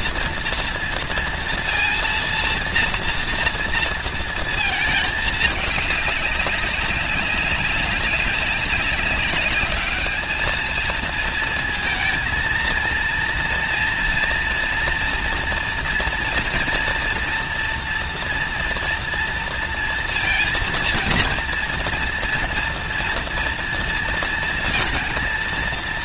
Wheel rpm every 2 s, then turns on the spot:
230, 230, 230, 200, 200, 220, 230, 230, 230, 230, 230, 230, 230.
none